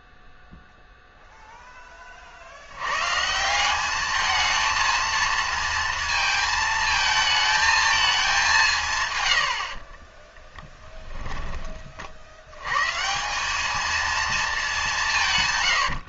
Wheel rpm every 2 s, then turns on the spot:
0, 110, 230, 220, 140, 10, 130, 170.
10-12